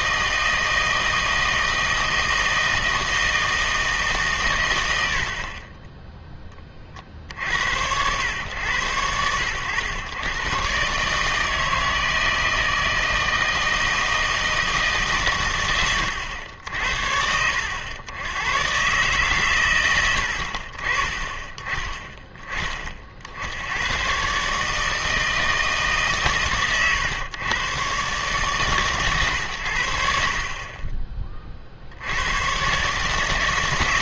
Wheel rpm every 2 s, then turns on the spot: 160, 160, 120, 30, 90, 120, 160, 160, 80, 120, 50, 20, 140, 130, 130, 30, 120.
none